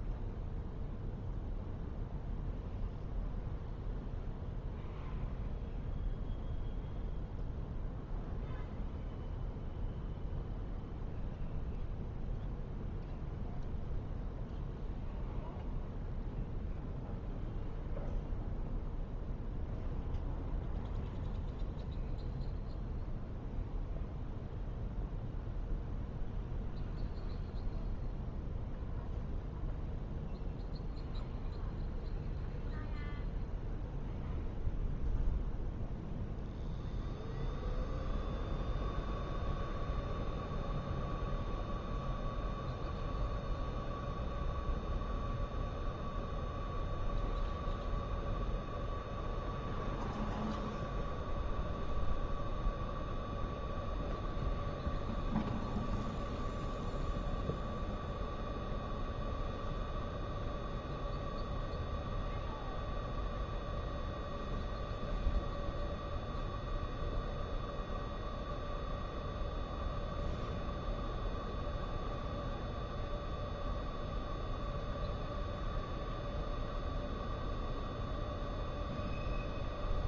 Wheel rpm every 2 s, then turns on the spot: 0, 0, 0, 0, 0, 0, 0, 0, 0, 0, 0, 0, 0, 0, 0, 0, 0, 0, 0, 0, 0, 0, 0, 0, 0, 0, 0, 0, 0, 0, 0, 0, 0, 0, 0, 0, 0, 0, 0, 0.
none